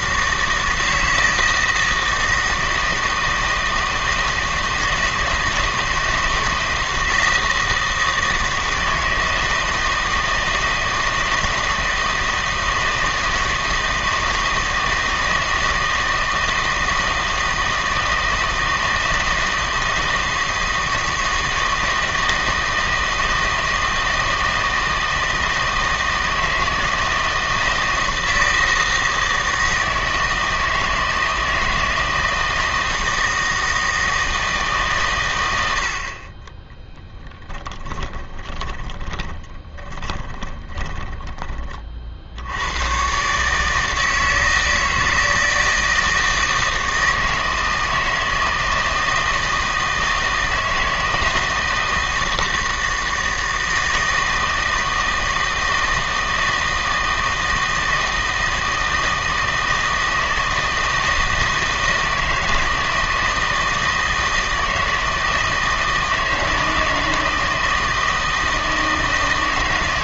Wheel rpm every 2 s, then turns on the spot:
160, 160, 160, 160, 160, 160, 160, 160, 160, 160, 160, 160, 160, 160, 160, 160, 160, 150, 20, 20, 20, 90, 160, 160, 160, 160, 160, 160, 160, 160, 160, 160, 160, 160, 160.
38-42